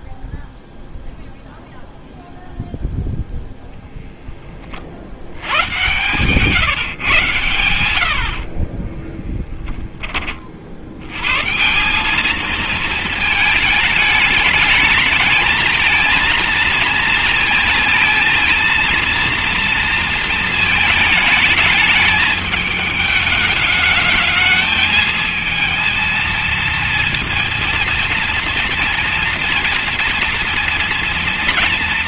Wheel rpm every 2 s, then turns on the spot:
0, 0, 20, 130, 40, 40, 220, 210, 230, 230, 220, 210, 220, 230, 240, 230.
8-10